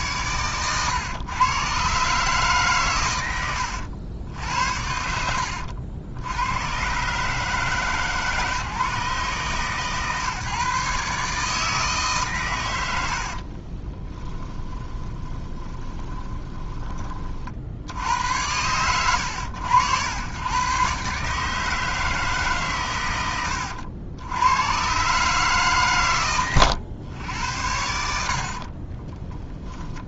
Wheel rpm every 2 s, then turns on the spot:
110, 140, 70, 90, 150, 150, 110, 20, 20, 90, 120, 130, 110, 110, 40.
4-6 14-16